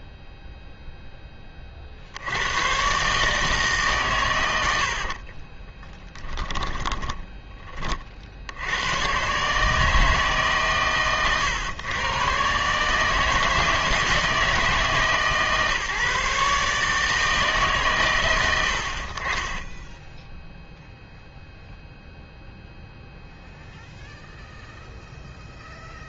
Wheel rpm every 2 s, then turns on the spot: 0, 120, 80, 20, 100, 140, 150, 160, 150, 70, 0, 0, 0.
6-8